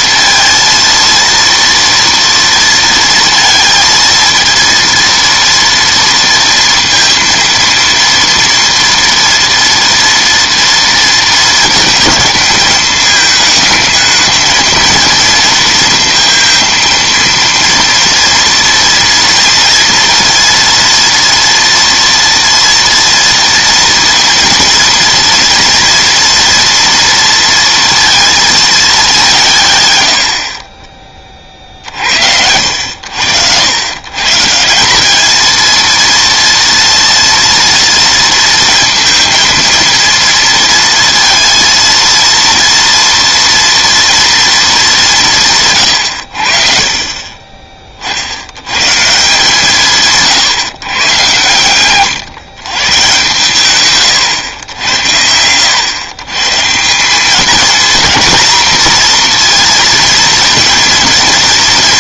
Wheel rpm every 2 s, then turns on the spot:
230, 230, 230, 230, 230, 230, 220, 220, 230, 230, 230, 230, 230, 230, 220, 40, 70, 170, 230, 230, 230, 230, 220, 50, 100, 140, 140, 90, 150, 230, 220.
none